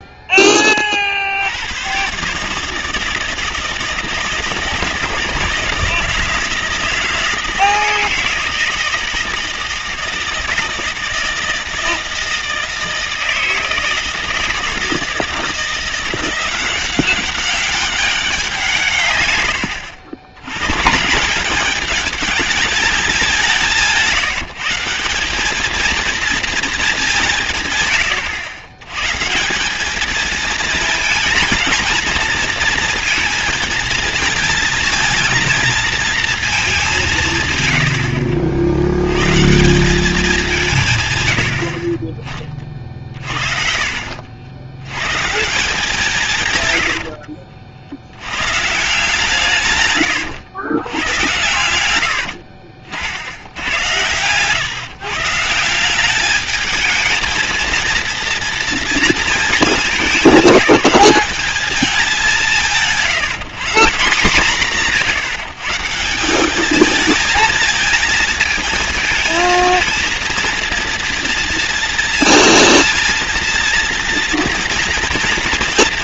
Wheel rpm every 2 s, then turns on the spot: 50, 160, 160, 160, 160, 160, 160, 160, 190, 140, 140, 200, 180, 210, 100, 230, 230, 230, 190, 80, 150, 40, 100, 110, 150, 110, 60, 140, 220, 230, 200, 160, 160, 210, 220, 230, 230, 230.
42-44 46-48